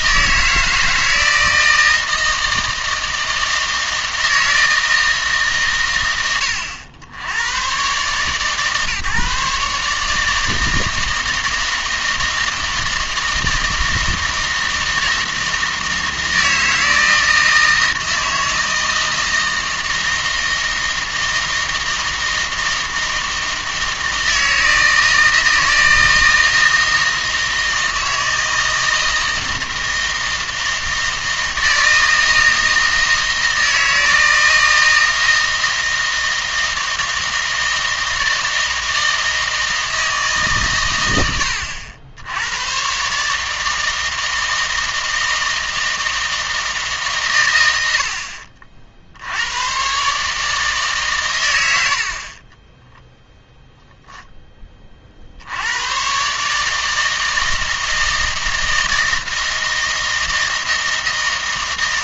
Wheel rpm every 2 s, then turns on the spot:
160, 160, 160, 90, 140, 160, 160, 160, 160, 160, 160, 160, 160, 160, 160, 160, 160, 160, 160, 160, 120, 120, 160, 160, 60, 150, 10, 20, 160, 160, 160.
52-54